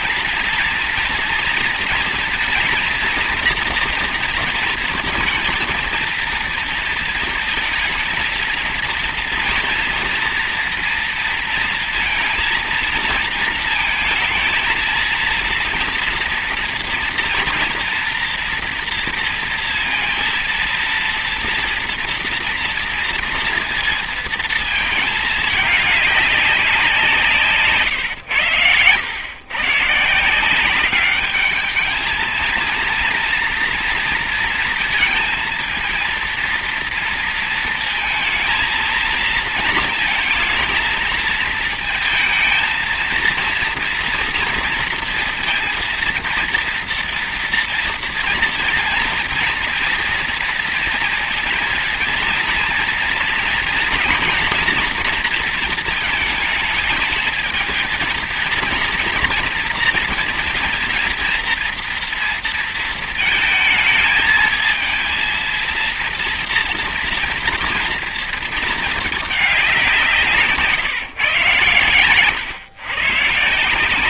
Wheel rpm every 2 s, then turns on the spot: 230, 230, 230, 220, 230, 230, 230, 230, 230, 230, 230, 230, 220, 180, 100, 200, 230, 230, 230, 230, 230, 230, 230, 230, 230, 230, 230, 230, 220, 230, 240, 230, 230, 230, 220, 140, 130.
none